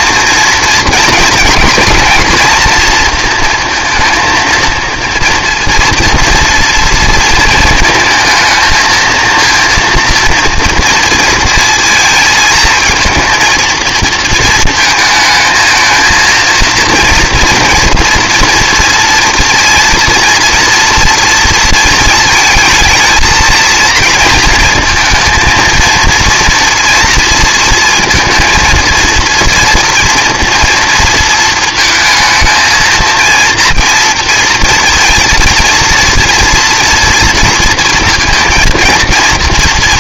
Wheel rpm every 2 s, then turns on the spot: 230, 230, 230, 230, 220, 230, 230, 230, 230, 230, 230, 220, 220, 230, 230, 230, 230, 230, 240, 230.
none